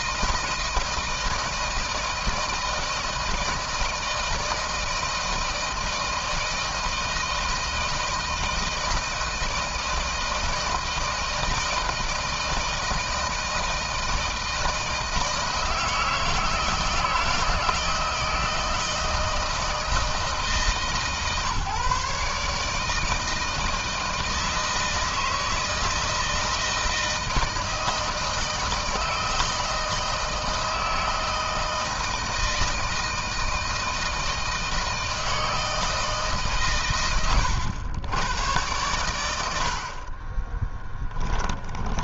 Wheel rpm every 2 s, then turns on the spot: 160, 160, 160, 160, 160, 160, 160, 160, 160, 160, 150, 150, 160, 160, 160, 160, 160, 160, 120, 110, 10.
40-42